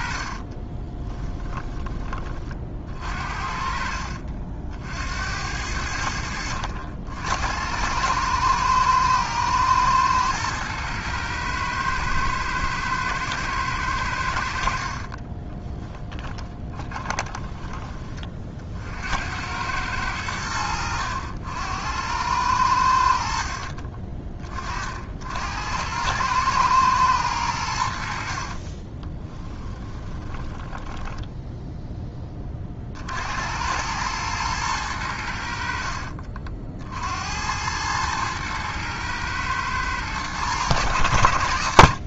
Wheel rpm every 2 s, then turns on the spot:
30, 30, 50, 90, 110, 110, 110, 70, 20, 40, 80, 90, 30, 110, 40, 10, 40, 110, 60, 110, 120.
0-2 16-18 28-32